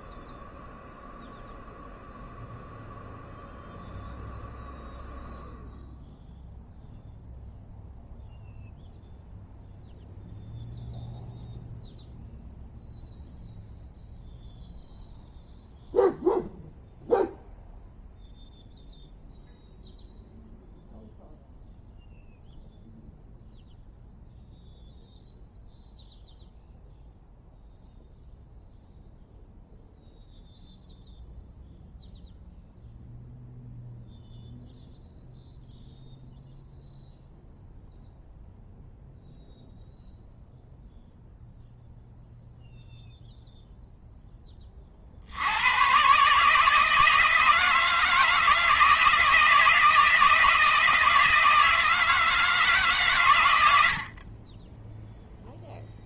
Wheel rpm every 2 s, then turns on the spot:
0, 0, 0, 0, 0, 0, 0, 0, 0, 0, 0, 0, 0, 0, 0, 0, 0, 0, 0, 0, 0, 0, 30, 160, 160, 160, 150, 10.
none